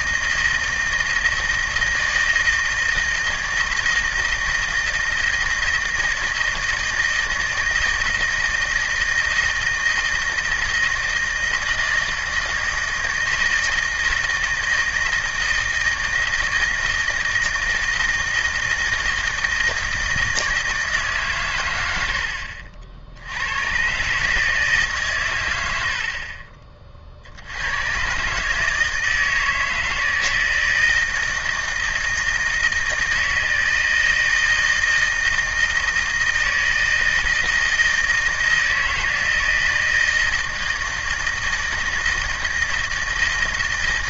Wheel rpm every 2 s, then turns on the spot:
160, 160, 160, 160, 160, 160, 160, 160, 160, 160, 160, 60, 150, 40, 150, 160, 160, 160, 160, 160, 160, 160.
none